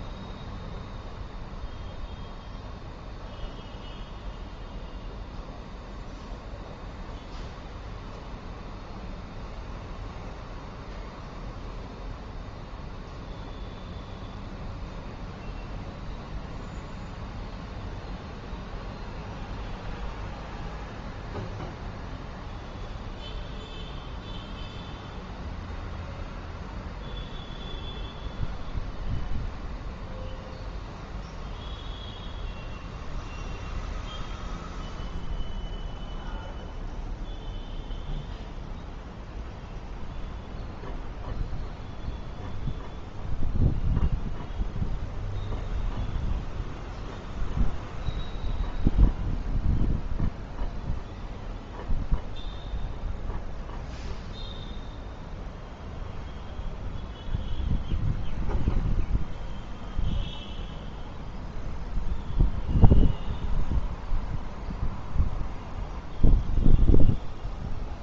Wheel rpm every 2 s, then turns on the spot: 0, 0, 0, 0, 0, 0, 0, 0, 0, 0, 0, 0, 0, 0, 0, 0, 0, 0, 0, 0, 0, 0, 0, 0, 0, 0, 0, 0, 0, 0, 0, 0, 0, 0.
none